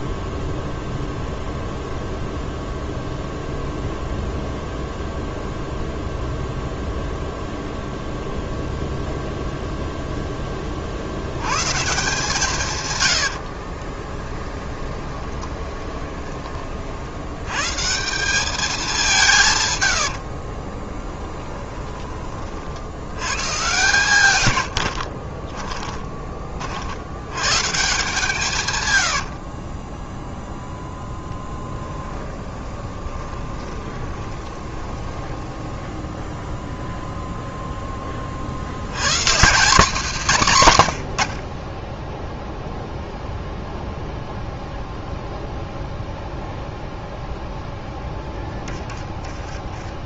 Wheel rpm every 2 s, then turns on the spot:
0, 0, 0, 0, 0, 50, 130, 20, 50, 200, 30, 70, 90, 70, 130, 0, 20, 20, 0, 70, 150, 0, 0, 0, 20.
12-16 20-22 24-26 28-30 32-36 48-50